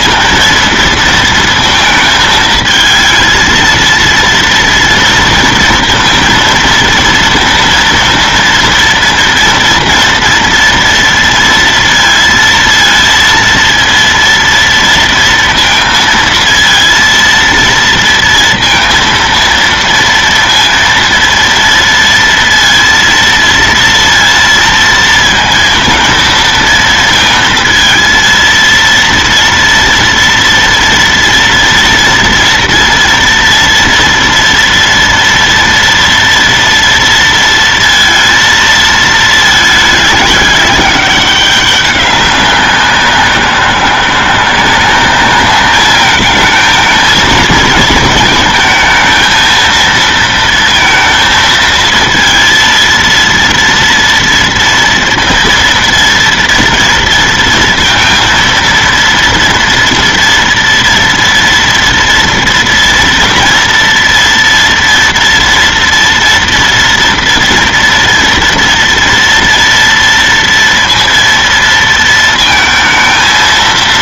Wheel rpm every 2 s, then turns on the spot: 230, 220, 230, 230, 230, 230, 230, 230, 230, 230, 230, 230, 230, 230, 230, 230, 240, 230, 230, 220, 200, 190, 180, 220, 230, 230, 230, 230, 230, 230, 230, 230, 230, 230, 230, 230, 230.
none